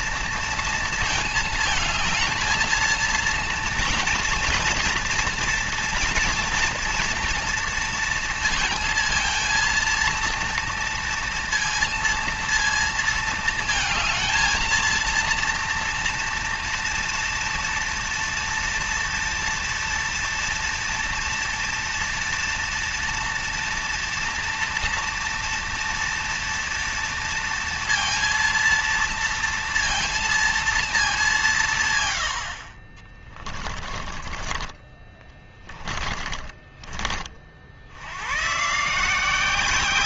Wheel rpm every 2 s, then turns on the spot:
230, 220, 230, 230, 230, 230, 230, 230, 230, 230, 230, 230, 230, 230, 230, 220, 60, 30, 20, 130.
34-38